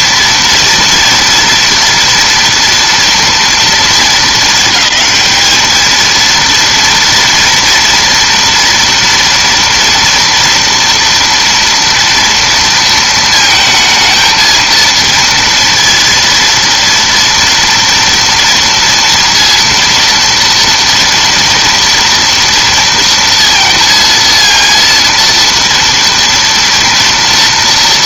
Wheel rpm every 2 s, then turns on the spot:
230, 230, 210, 230, 230, 230, 230, 230, 230, 230, 240, 230, 230, 230.
none